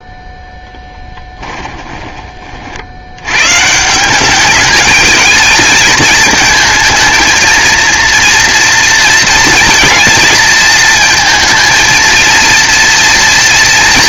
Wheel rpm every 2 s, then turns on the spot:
0, 50, 210, 220, 230, 230, 230.
none